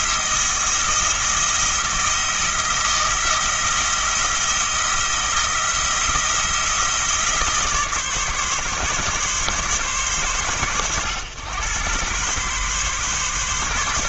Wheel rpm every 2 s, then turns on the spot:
170, 170, 170, 170, 140, 100, 130.
none